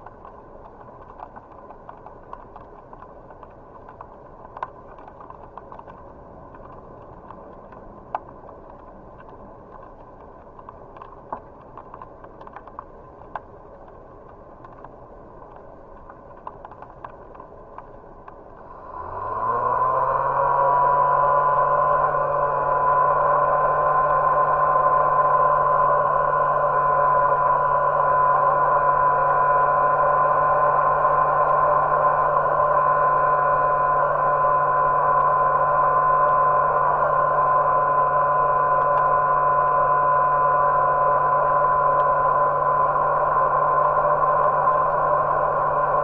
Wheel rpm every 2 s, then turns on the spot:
0, 0, 0, 0, 0, 0, 0, 0, 0, 0, 0, 0, 0, 0, 0, 0, 0, 0, 0, 0, 0, 0, 0.
none